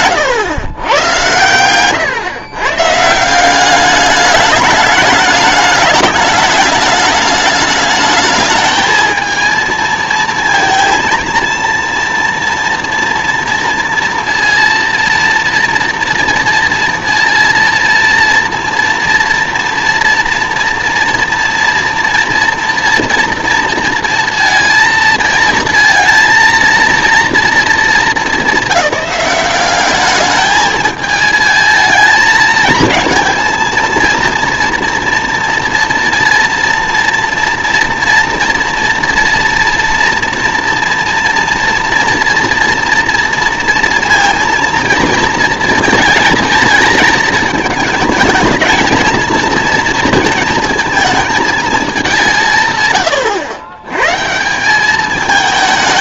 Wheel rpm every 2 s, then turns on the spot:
130, 130, 210, 210, 210, 230, 230, 230, 230, 230, 230, 240, 230, 230, 200, 220, 220, 230, 230, 230, 240, 230, 230, 220, 220, 230, 150, 180.
none